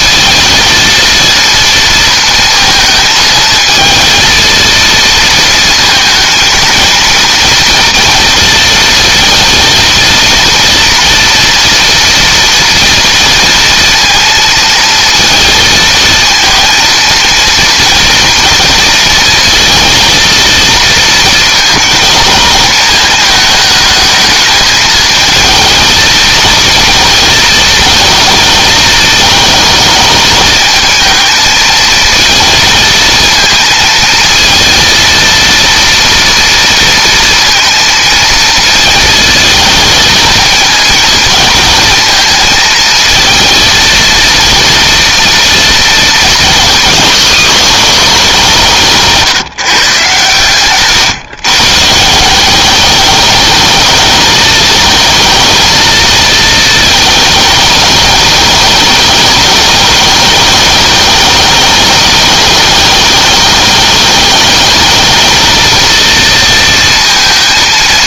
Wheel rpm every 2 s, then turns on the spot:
230, 220, 230, 230, 230, 230, 230, 230, 230, 230, 230, 220, 220, 230, 220, 220, 230, 230, 230, 220, 230, 220, 240, 220, 170, 130, 210, 220, 220, 210, 210, 210, 220, 230.
none